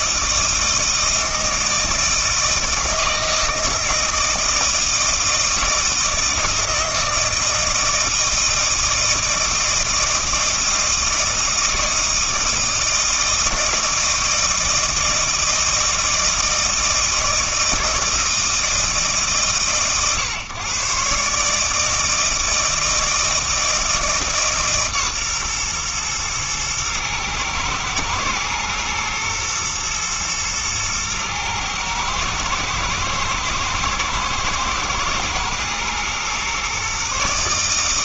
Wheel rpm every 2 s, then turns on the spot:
160, 160, 160, 160, 160, 160, 160, 160, 160, 160, 120, 160, 150, 110, 120, 110, 110, 110, 130.
none